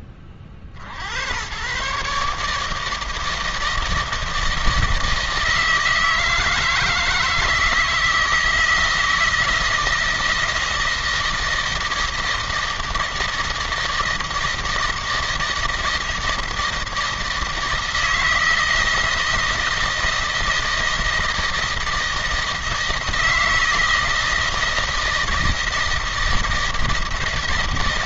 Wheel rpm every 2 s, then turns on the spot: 50, 150, 160, 160, 160, 160, 160, 160, 160, 160, 160, 160, 160, 160.
none